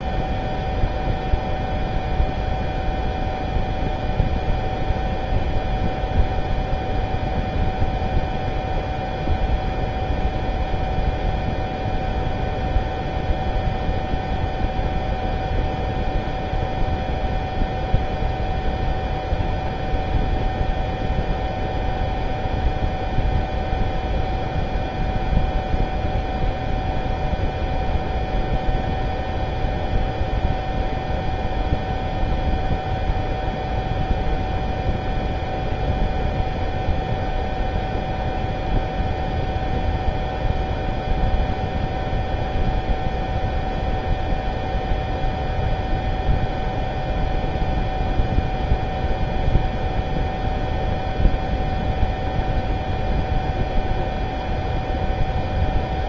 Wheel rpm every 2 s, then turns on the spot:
0, 0, 0, 0, 0, 0, 0, 0, 0, 0, 0, 0, 0, 0, 0, 0, 0, 0, 0, 0, 0, 0, 0, 0, 0, 0, 0, 0.
none